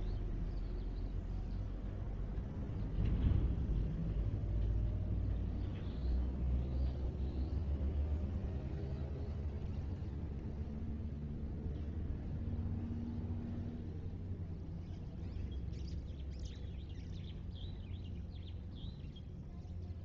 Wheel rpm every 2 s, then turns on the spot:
0, 0, 0, 0, 0, 0, 0, 0, 0, 0.
none